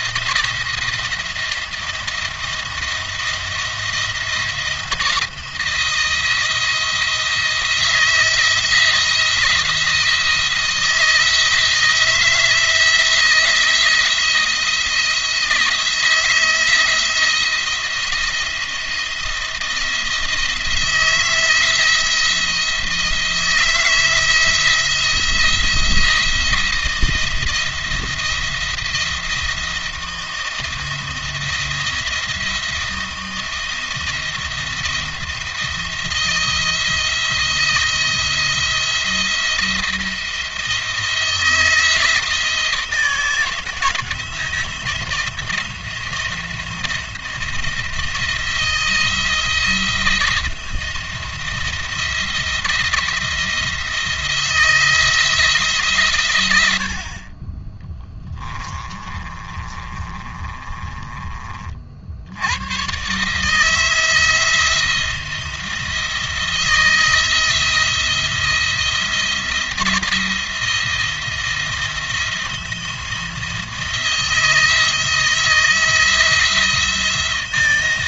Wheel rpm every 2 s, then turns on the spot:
170, 170, 170, 170, 170, 160, 160, 170, 170, 170, 160, 170, 170, 170, 170, 160, 170, 170, 170, 170, 170, 170, 170, 170, 160, 160, 170, 170, 80, 30, 30, 110, 170, 160, 170, 170, 170, 160, 170.
58-62